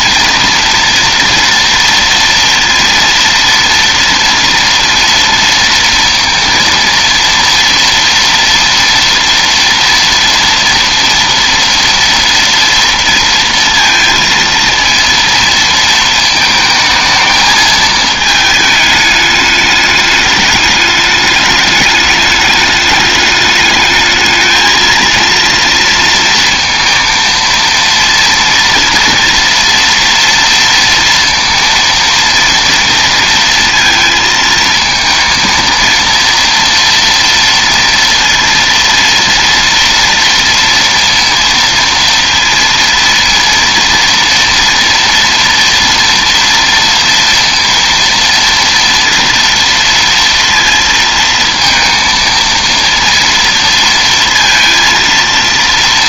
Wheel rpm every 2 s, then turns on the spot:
230, 230, 230, 230, 230, 230, 230, 230, 220, 210, 210, 210, 230, 230, 230, 230, 230, 230, 230, 230, 230, 230, 230, 230, 240, 230, 230, 230.
none